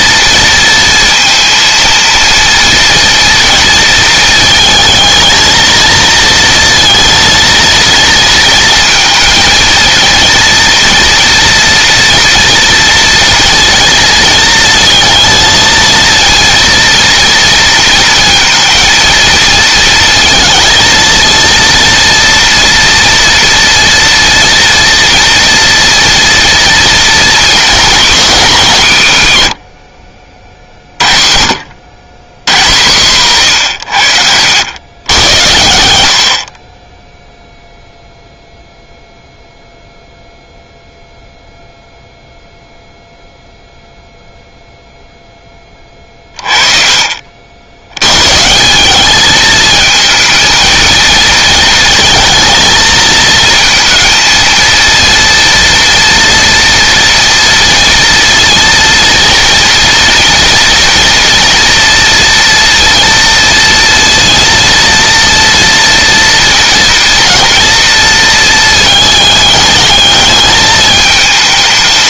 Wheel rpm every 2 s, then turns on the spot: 230, 240, 220, 230, 230, 240, 240, 230, 230, 230, 230, 230, 240, 220, 140, 40, 130, 100, 10, 0, 0, 0, 0, 40, 200, 220, 220, 230, 230, 230, 230, 230, 230, 220, 220, 220.
none